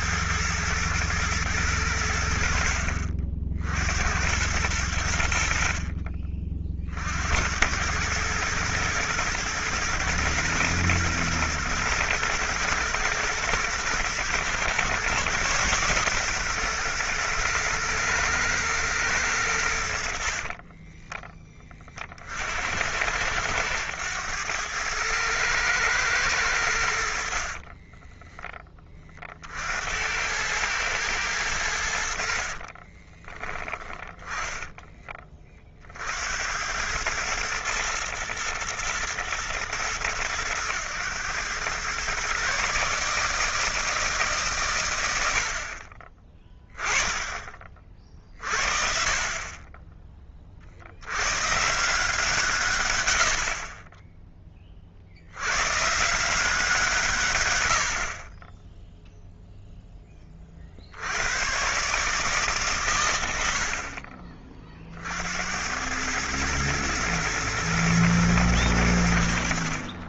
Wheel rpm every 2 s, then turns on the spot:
110, 70, 90, 40, 110, 120, 120, 120, 120, 120, 40, 70, 100, 100, 20, 100, 50, 10, 90, 120, 110, 140, 130, 30, 50, 40, 150, 20, 160, 20, 30, 140, 40, 110, 110.
20-22 32-34